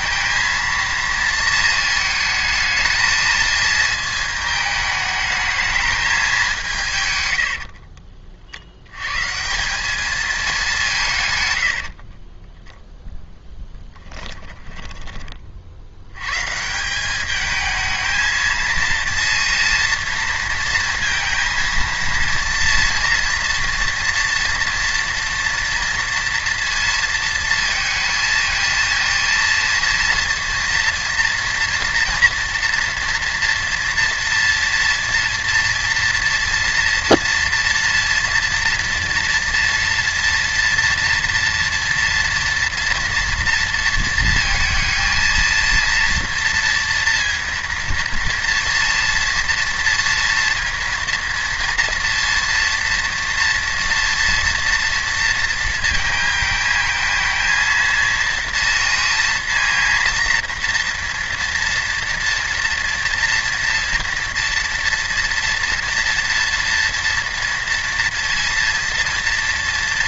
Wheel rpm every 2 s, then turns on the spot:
230, 220, 220, 180, 70, 210, 20, 10, 140, 220, 230, 230, 230, 230, 230, 230, 240, 230, 230, 240, 230, 230, 230, 230, 230, 230, 230, 230, 220, 230, 230, 230, 240, 240, 230.
12-16